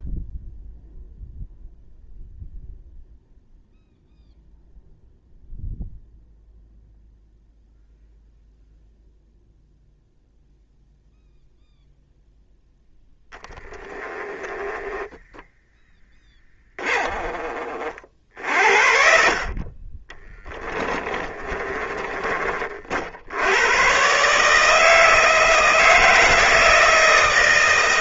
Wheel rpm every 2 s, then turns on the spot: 0, 0, 0, 0, 0, 0, 0, 10, 20, 50, 20, 50, 160, 160.
20-22